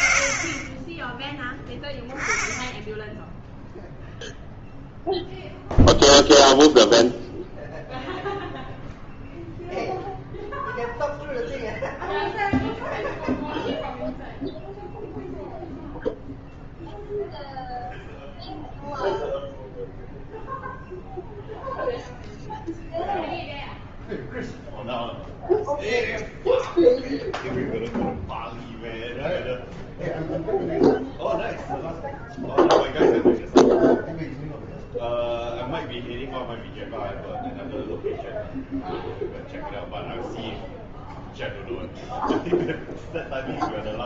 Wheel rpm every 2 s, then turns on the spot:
10, 0, 0, 0, 0, 0, 0, 0, 0, 0, 0, 0, 0, 0, 0, 0, 0, 0, 0, 0, 0, 0.
none